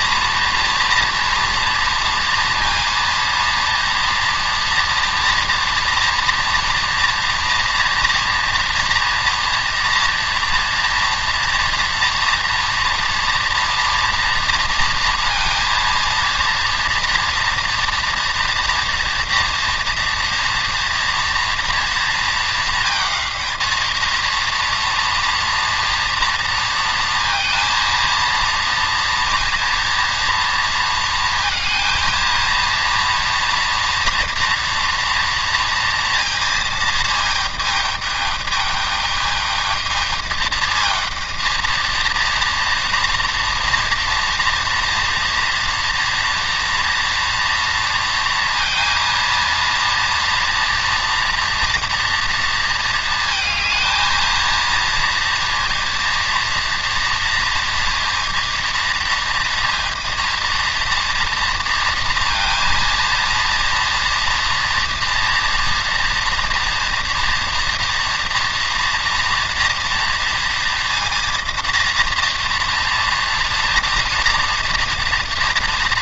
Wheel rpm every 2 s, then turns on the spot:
240, 230, 230, 230, 240, 230, 230, 230, 240, 240, 230, 220, 230, 230, 230, 230, 240, 230, 220, 210, 230, 230, 240, 230, 230, 230, 230, 230, 230, 230, 230, 230, 230, 230, 240, 230, 230, 230.
none